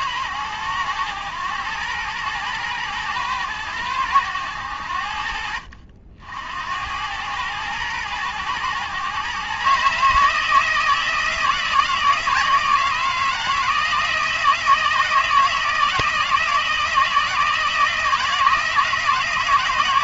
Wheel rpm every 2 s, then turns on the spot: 100, 110, 80, 90, 120, 160, 160, 160, 160, 160.
none